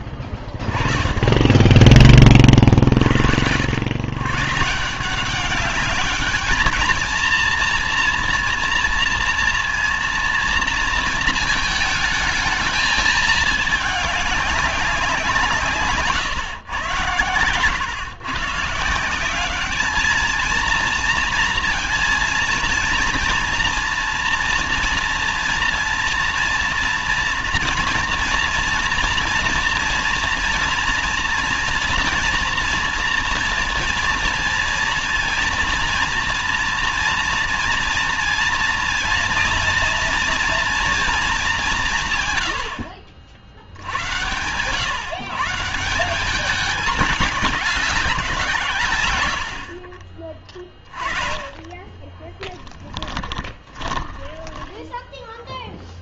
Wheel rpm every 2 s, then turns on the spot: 40, 40, 140, 210, 230, 230, 220, 200, 120, 140, 230, 230, 230, 230, 230, 230, 230, 230, 230, 230, 240, 100, 100, 200, 160, 30, 10, 0.
52-54